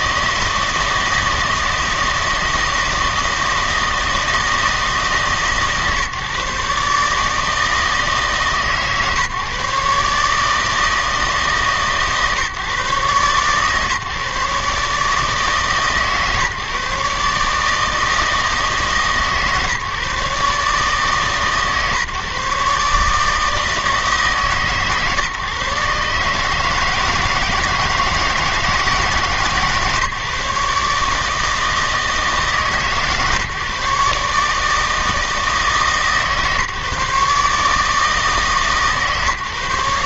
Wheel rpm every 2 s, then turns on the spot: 160, 160, 160, 140, 150, 150, 150, 150, 140, 160, 150, 150, 140, 150, 160, 150, 150, 150, 150, 150.
none